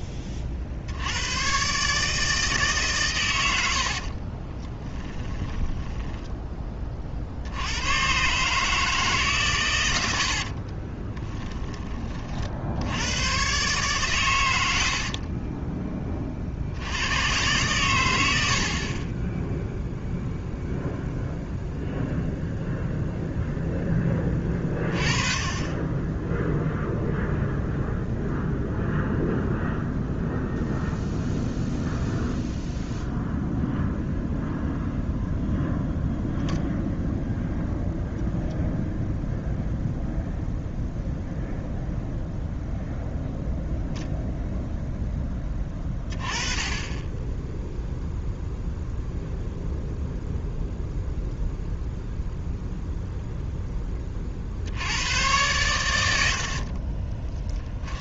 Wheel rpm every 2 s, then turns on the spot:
40, 140, 20, 30, 150, 30, 80, 80, 90, 20, 0, 0, 20, 0, 0, 0, 0, 0, 0, 0, 0, 0, 0, 20, 0, 0, 0, 80, 40.
4-6 10-12 56-58